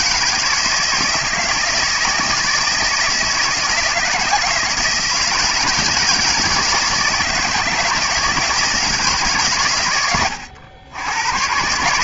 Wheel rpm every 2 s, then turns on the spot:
160, 160, 160, 160, 160, 90.
none